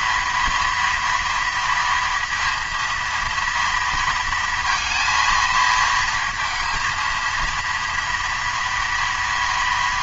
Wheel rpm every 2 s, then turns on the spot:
230, 230, 230, 230, 240.
none